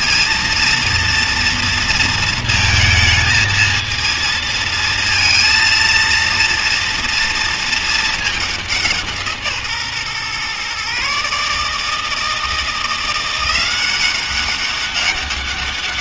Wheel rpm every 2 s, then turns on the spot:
230, 230, 230, 230, 170, 140, 170, 200.
none